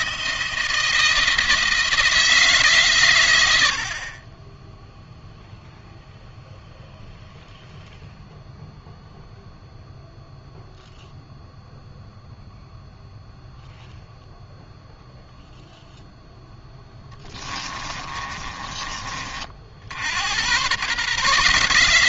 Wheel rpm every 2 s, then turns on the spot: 170, 150, 20, 0, 0, 0, 0, 0, 0, 30, 110.
18-20